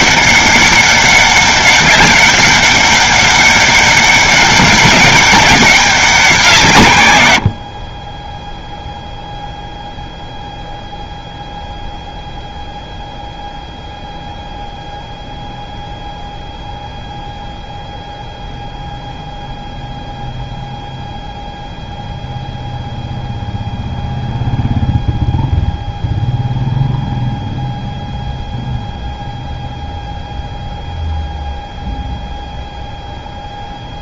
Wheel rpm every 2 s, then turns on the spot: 200, 200, 190, 180, 10, 0, 0, 0, 0, 0, 0, 0, 0, 0, 0, 0, 0.
none